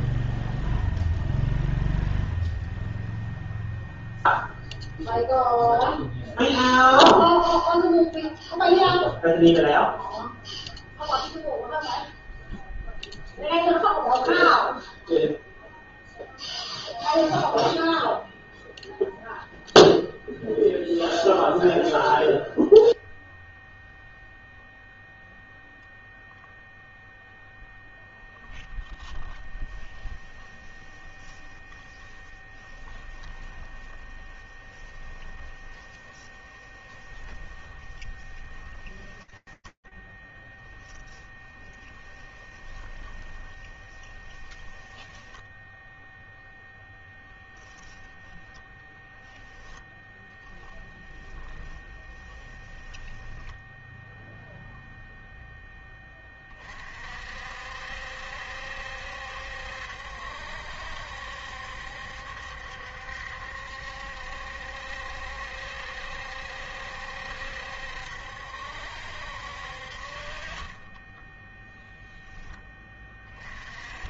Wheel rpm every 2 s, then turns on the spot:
0, 0, 0, 0, 0, 0, 0, 0, 0, 0, 0, 0, 0, 0, 10, 10, 10, 10, 10, 10, 10, 20, 0, 10, 10, 10, 0, 10, 60, 70, 70, 70, 70, 70, 50, 0, 20.
30-38 40-44 46-48 50-52